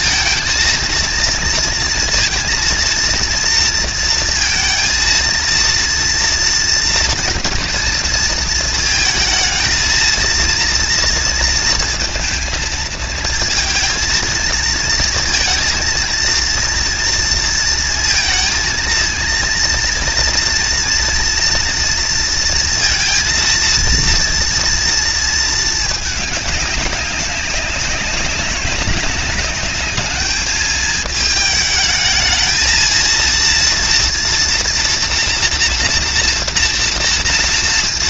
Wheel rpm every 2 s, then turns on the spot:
230, 230, 230, 230, 230, 230, 220, 230, 230, 230, 230, 230, 230, 200, 200, 220, 230, 240, 240.
none